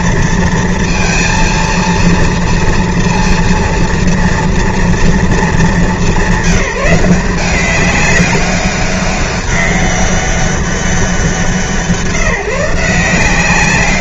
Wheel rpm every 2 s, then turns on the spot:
230, 230, 230, 190, 200, 200, 170.
none